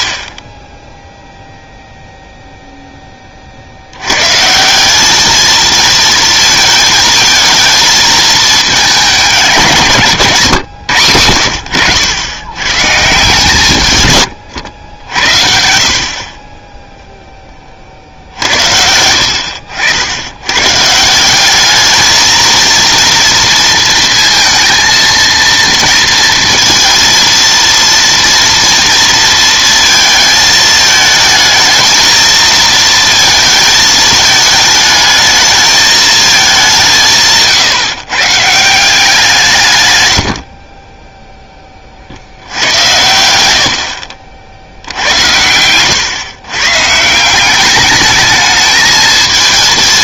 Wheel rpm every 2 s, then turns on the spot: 10, 0, 160, 230, 210, 140, 110, 100, 20, 60, 110, 230, 230, 230, 230, 220, 220, 220, 200, 160, 50, 70, 60, 140, 210.
none